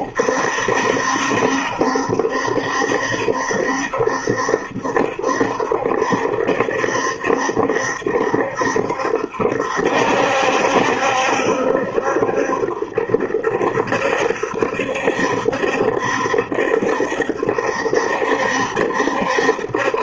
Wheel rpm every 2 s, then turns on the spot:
70, 70, 70, 70, 70, 70, 70, 70, 70, 70.
none